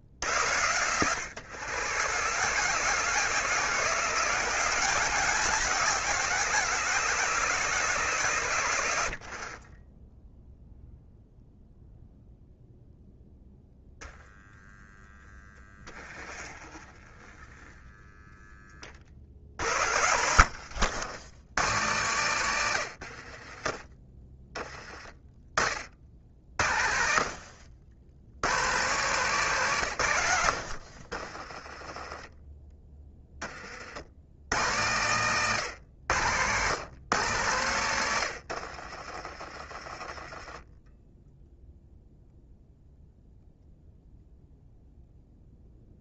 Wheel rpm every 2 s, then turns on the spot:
100, 160, 180, 160, 70, 0, 0, 0, 20, 30, 90, 90, 10, 60, 140, 60, 10, 120, 120, 50, 10, 0, 0.
16-18 20-22 38-40